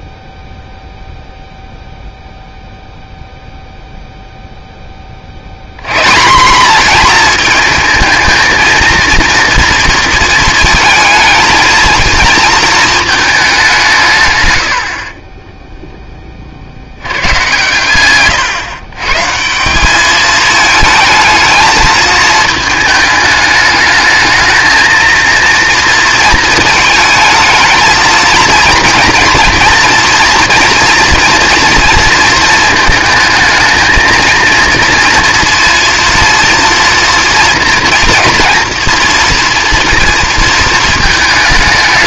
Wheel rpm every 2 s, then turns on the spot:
0, 0, 10, 210, 230, 230, 230, 100, 50, 130, 220, 220, 220, 220, 230, 230, 230, 230, 230, 230, 220.
none